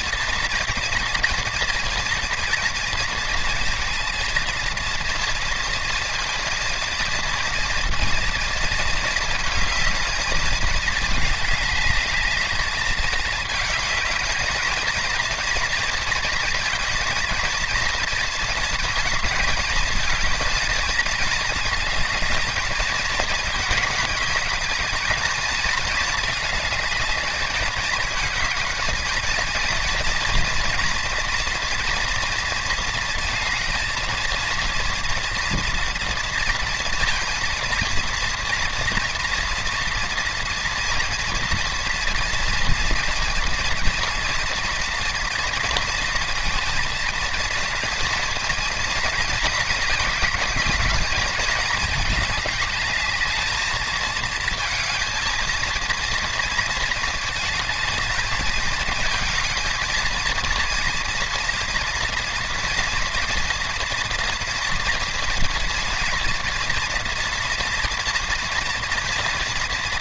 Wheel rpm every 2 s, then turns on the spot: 230, 230, 230, 230, 220, 210, 210, 230, 230, 230, 220, 220, 220, 220, 220, 230, 230, 230, 230, 230, 230, 230, 230, 230, 230, 210, 210, 220, 220, 220, 230, 230, 230, 240, 230.
none